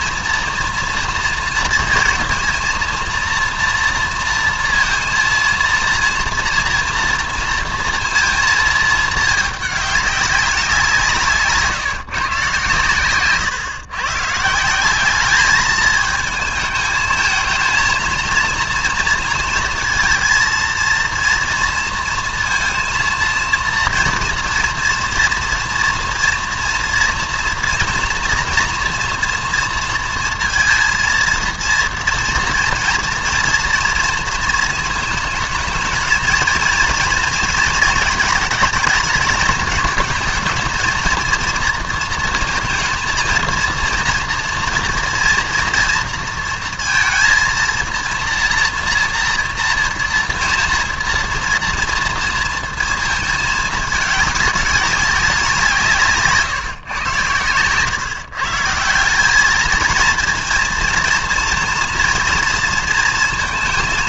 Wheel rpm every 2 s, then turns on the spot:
230, 230, 230, 230, 220, 180, 130, 170, 220, 230, 230, 230, 230, 230, 230, 230, 230, 230, 230, 210, 220, 230, 240, 230, 230, 230, 220, 200, 140, 160, 230, 230.
none